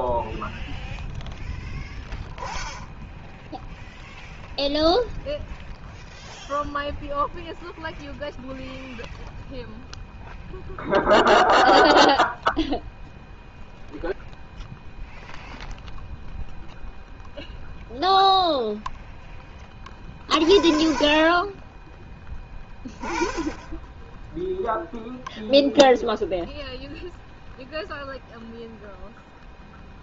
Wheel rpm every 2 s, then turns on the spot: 0, 0, 0, 0, 0, 0, 0, 0, 0, 0, 40, 10, 0, 0, 0.
none